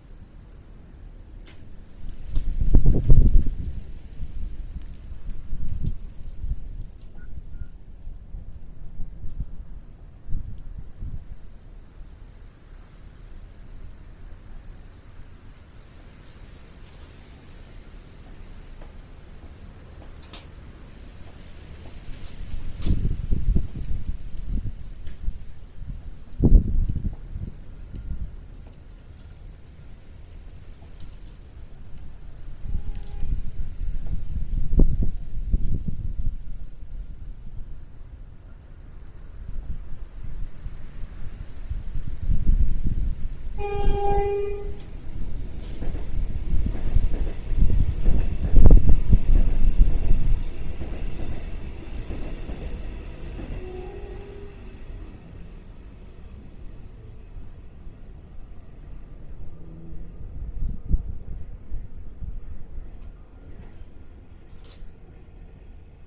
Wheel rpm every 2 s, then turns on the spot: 0, 0, 0, 0, 0, 0, 0, 0, 0, 0, 0, 0, 0, 0, 0, 0, 0, 0, 0, 0, 0, 0, 0, 0, 0, 0, 0, 0, 0, 0, 0, 0, 0.
none